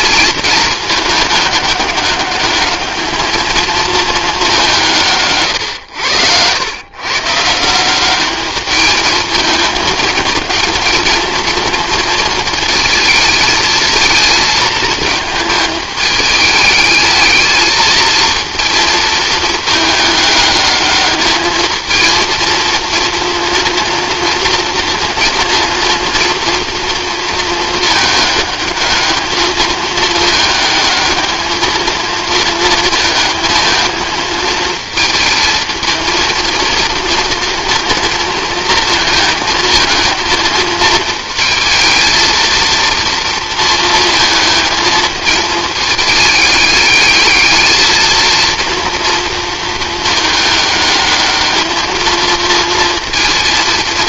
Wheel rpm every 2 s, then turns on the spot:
220, 210, 190, 120, 210, 220, 220, 220, 210, 230, 210, 230, 230, 230, 210, 220, 220, 220, 230, 230, 220, 230, 220, 210, 230, 210, 230.
none